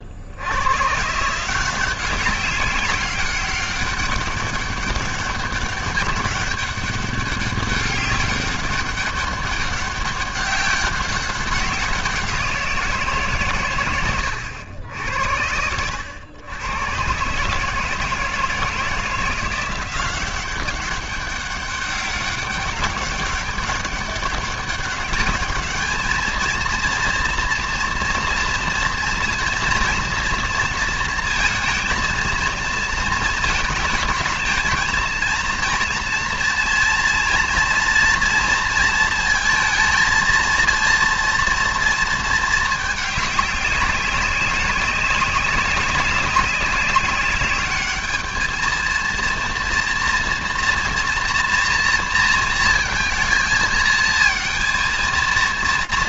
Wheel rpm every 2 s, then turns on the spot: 130, 190, 200, 200, 200, 190, 160, 80, 120, 170, 200, 190, 200, 230, 230, 230, 220, 230, 230, 230, 230, 210, 200, 200, 230, 230, 220, 230.
none